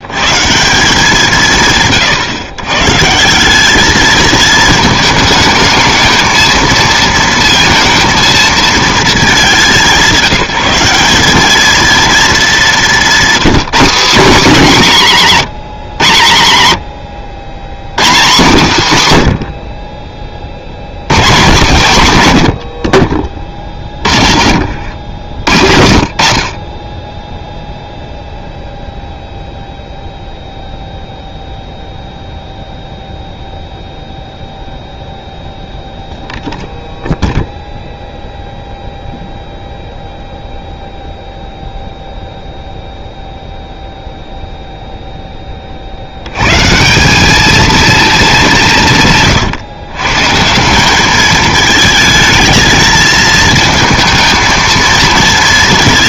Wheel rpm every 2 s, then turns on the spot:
160, 140, 220, 220, 220, 190, 200, 210, 110, 170, 50, 120, 100, 60, 0, 0, 0, 0, 0, 0, 0, 0, 0, 130, 180, 180, 220, 230.
16-18 22-26